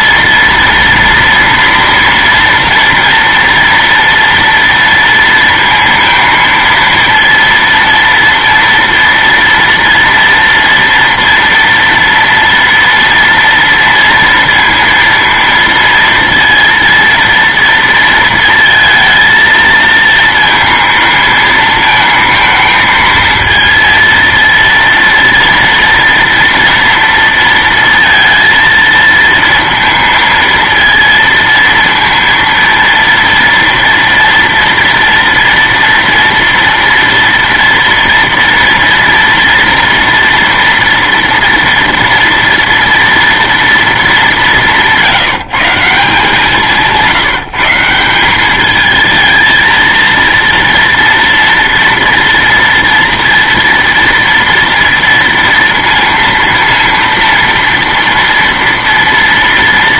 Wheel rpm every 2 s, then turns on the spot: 230, 240, 230, 230, 230, 230, 230, 230, 230, 230, 230, 220, 230, 240, 230, 230, 230, 230, 230, 230, 230, 230, 200, 170, 190, 230, 230, 230, 230, 230.
none